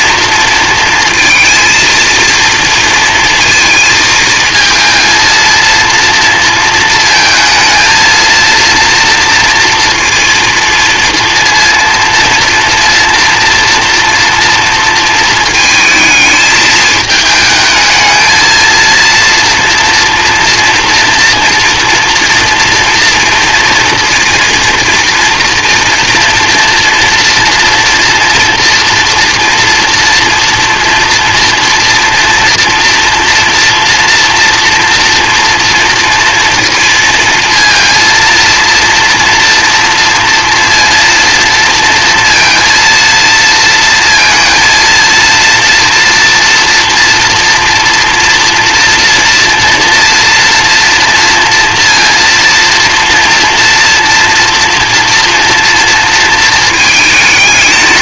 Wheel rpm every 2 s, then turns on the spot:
230, 230, 220, 230, 230, 230, 230, 230, 220, 230, 230, 230, 230, 230, 230, 230, 240, 230, 230, 230, 230, 230, 230, 230, 230, 230, 230, 230, 220.
none